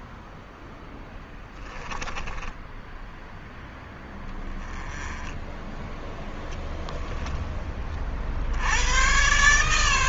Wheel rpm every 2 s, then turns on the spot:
10, 10, 10, 20, 100.
0-2